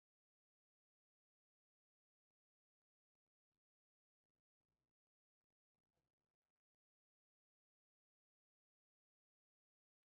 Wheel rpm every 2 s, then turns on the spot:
0, 0, 0, 0, 0.
none